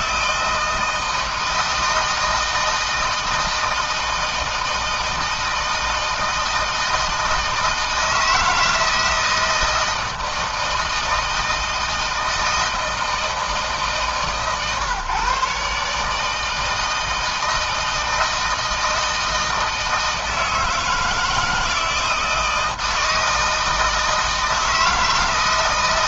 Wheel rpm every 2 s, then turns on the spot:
160, 160, 160, 160, 160, 160, 160, 140, 160, 160, 160, 160, 160.
none